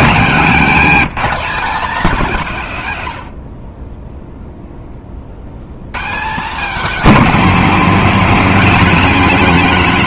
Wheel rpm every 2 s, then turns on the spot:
210, 180, 0, 220, 220.
none